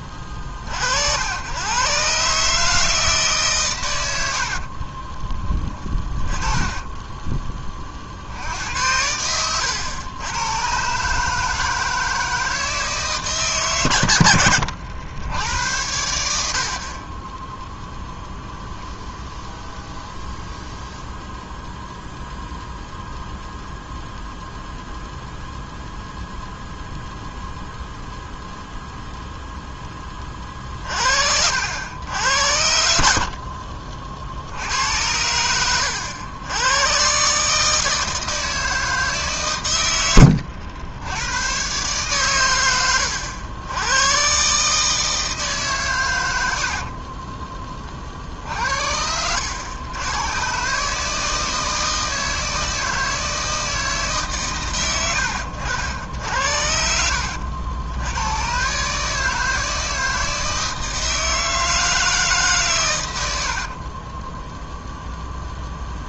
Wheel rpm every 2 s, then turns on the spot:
40, 150, 70, 20, 70, 110, 160, 80, 80, 0, 0, 0, 0, 0, 0, 40, 80, 70, 100, 160, 90, 110, 140, 70, 60, 120, 160, 130, 60, 120, 160, 140, 10.
4-8 46-48 64-66